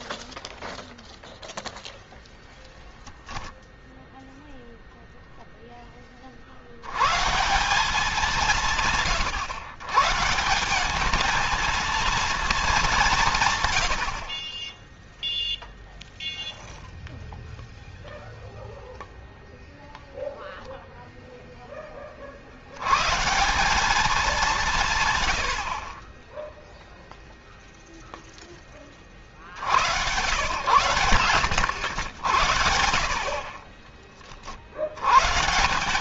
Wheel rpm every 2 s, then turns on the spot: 0, 0, 0, 140, 120, 210, 160, 0, 0, 0, 0, 90, 140, 0, 20, 110, 50, 60.
none